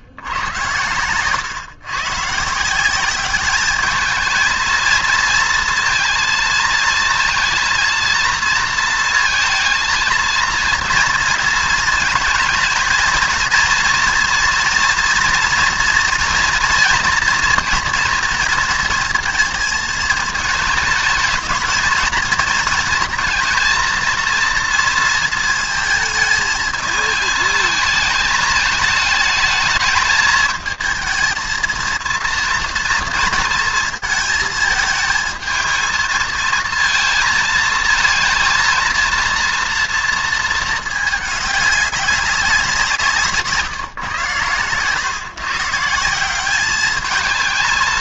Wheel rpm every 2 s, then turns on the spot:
100, 160, 230, 220, 230, 230, 220, 230, 230, 230, 220, 230, 230, 220, 210, 220, 230, 220, 230, 230, 220, 190, 120, 200.
none